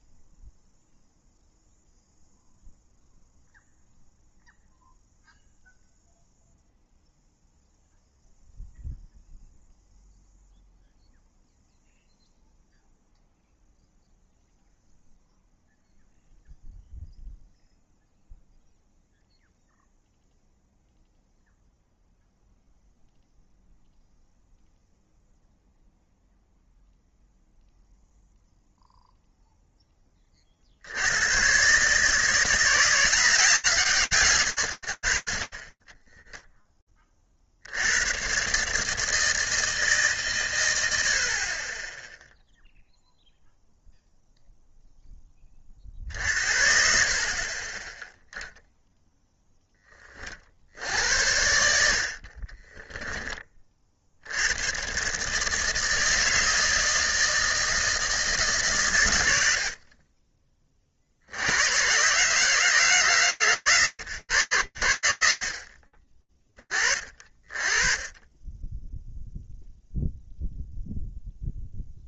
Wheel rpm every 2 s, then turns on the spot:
0, 0, 0, 0, 0, 0, 0, 0, 0, 0, 0, 0, 0, 0, 0, 40, 160, 120, 10, 120, 110, 0, 0, 40, 0, 60, 20, 120, 160, 130, 50, 150, 100, 40, 20, 0.
52-54